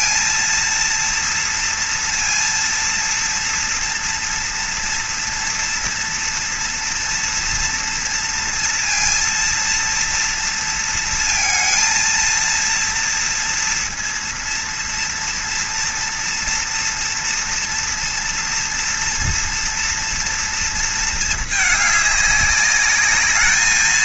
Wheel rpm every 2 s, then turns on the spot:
230, 230, 230, 230, 230, 230, 230, 240, 240, 240, 230, 200.
none